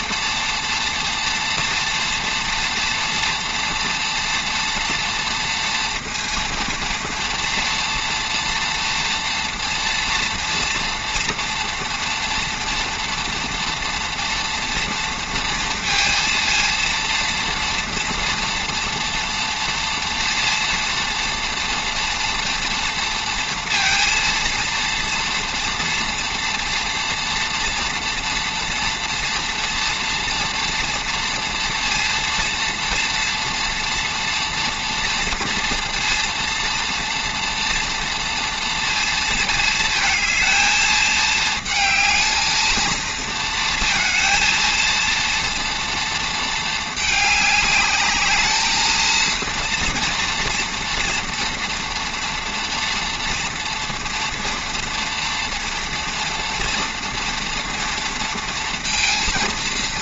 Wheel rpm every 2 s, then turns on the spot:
230, 230, 230, 240, 230, 230, 230, 230, 230, 230, 230, 230, 230, 230, 230, 230, 230, 230, 230, 230, 220, 230, 230, 210, 230, 230, 230, 230, 230, 230.
none